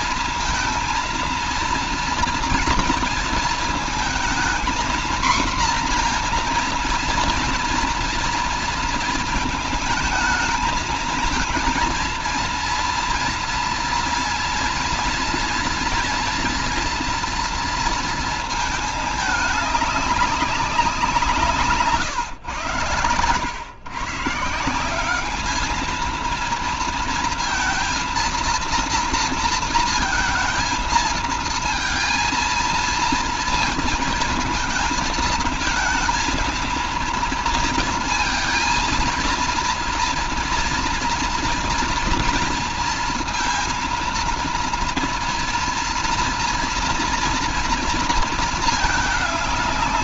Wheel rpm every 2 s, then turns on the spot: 230, 230, 240, 230, 230, 220, 230, 230, 240, 210, 180, 110, 200, 230, 230, 230, 230, 220, 230, 230, 230, 230, 230, 230, 210.
none